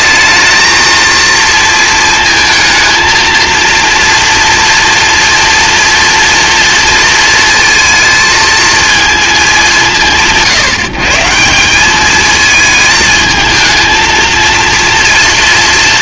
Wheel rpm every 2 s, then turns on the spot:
230, 220, 230, 230, 220, 150, 220, 230.
none